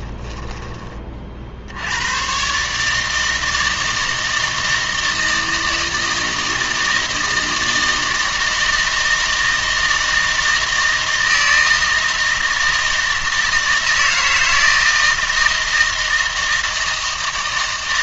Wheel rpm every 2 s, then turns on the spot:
20, 140, 160, 160, 160, 160, 160, 160, 160.
none